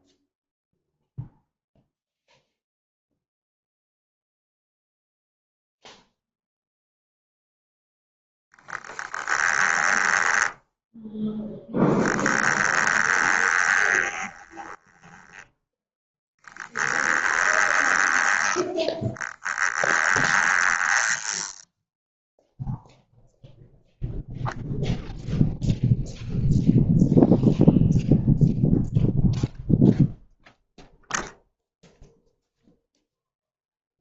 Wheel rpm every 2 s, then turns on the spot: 0, 0, 0, 0, 10, 10, 20, 10, 10, 10, 20, 0, 0, 0, 0, 0, 0.
8-10 12-22